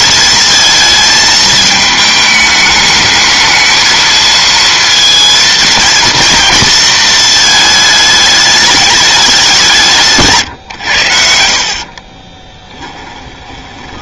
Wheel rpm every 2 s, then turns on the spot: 220, 210, 230, 230, 210, 140, 20.
12-14